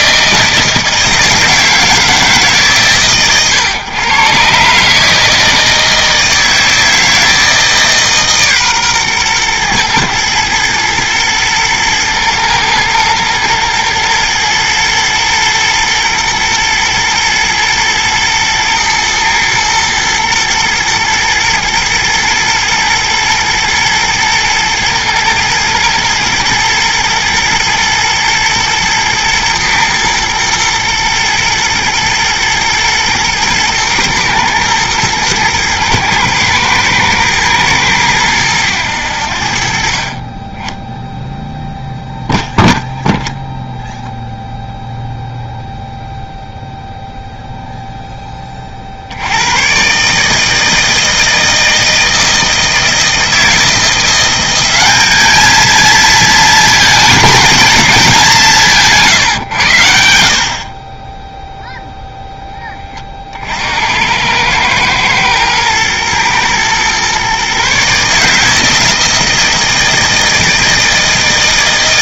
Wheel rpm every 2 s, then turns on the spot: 160, 130, 160, 160, 120, 110, 110, 110, 110, 120, 120, 120, 110, 110, 120, 110, 120, 110, 110, 70, 0, 10, 0, 0, 50, 160, 160, 200, 220, 160, 20, 20, 110, 120, 160, 160.
none